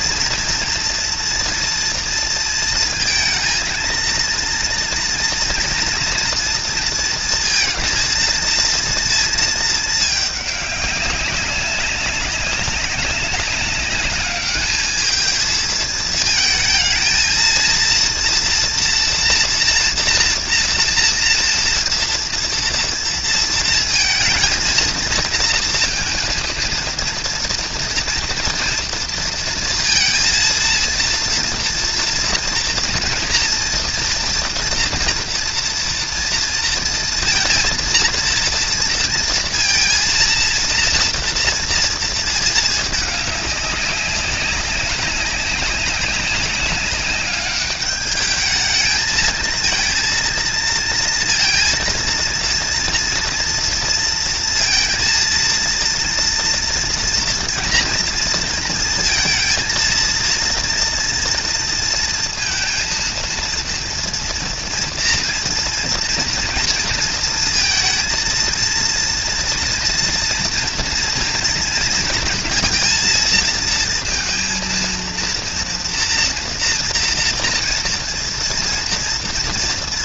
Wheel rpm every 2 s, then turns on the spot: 230, 230, 230, 230, 230, 200, 200, 210, 220, 230, 230, 230, 230, 230, 230, 230, 230, 230, 230, 230, 230, 210, 190, 190, 220, 230, 230, 230, 230, 230, 230, 230, 230, 230, 230, 230, 230, 230, 230, 230.
none